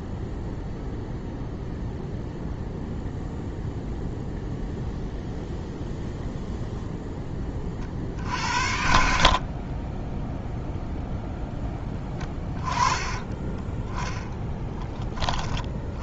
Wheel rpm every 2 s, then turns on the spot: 0, 0, 0, 0, 70, 0, 20, 10.
none